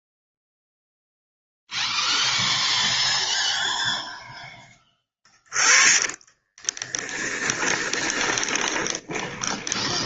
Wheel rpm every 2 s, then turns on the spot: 0, 0, 10, 20, 20.
6-10